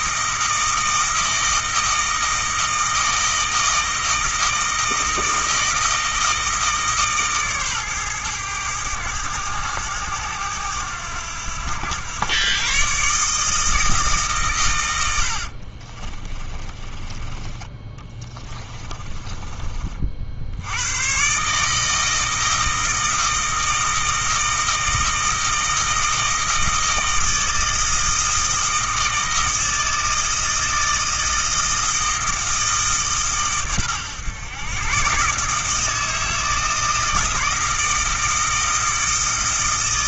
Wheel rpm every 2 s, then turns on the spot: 160, 160, 160, 150, 100, 90, 140, 90, 20, 20, 100, 160, 160, 160, 160, 160, 150, 140, 160, 160.
16-20